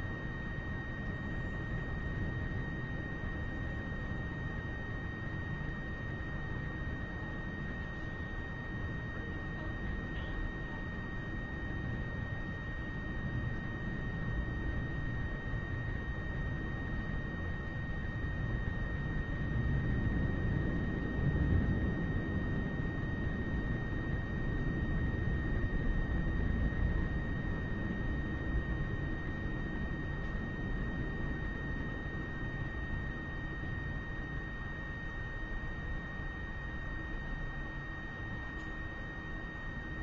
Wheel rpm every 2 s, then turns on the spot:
0, 0, 0, 0, 0, 0, 0, 0, 0, 0, 0, 0, 0, 0, 0, 0, 0, 0, 0, 0.
none